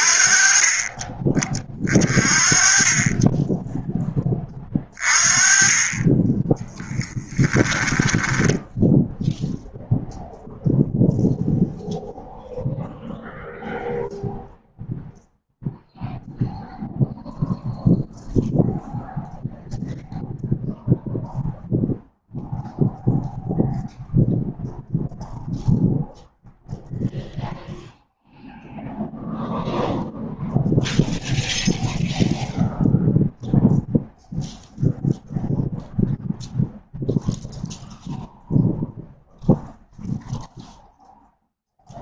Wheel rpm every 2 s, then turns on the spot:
30, 20, 30, 10, 0, 0, 0, 0, 0, 0, 0, 0, 0, 0, 0, 0, 0, 0, 0, 0, 0.
6-8